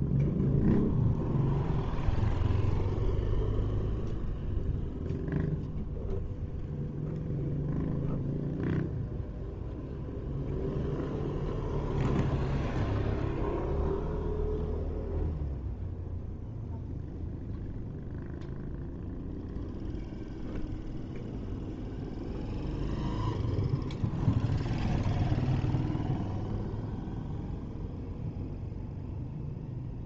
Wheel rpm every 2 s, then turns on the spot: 0, 0, 0, 0, 0, 0, 0, 0, 0, 0, 0, 0, 0, 0, 0.
none